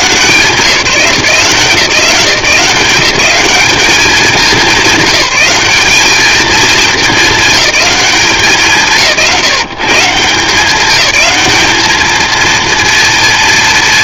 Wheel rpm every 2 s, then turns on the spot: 180, 190, 200, 220, 170, 190, 230.
none